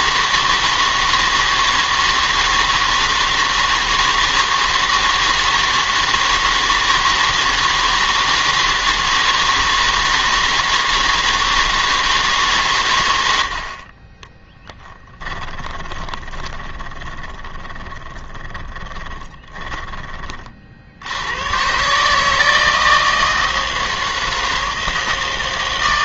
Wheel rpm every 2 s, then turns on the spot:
160, 160, 160, 160, 160, 160, 130, 10, 20, 10, 50, 160, 160.
14-20